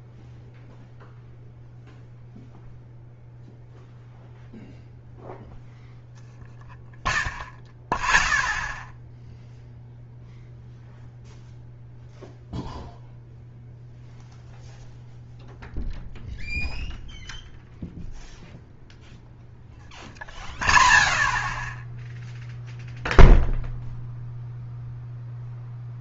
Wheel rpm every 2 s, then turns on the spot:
0, 0, 0, 0, 0, 0, 0, 0, 0, 0, 0, 0, 0.
none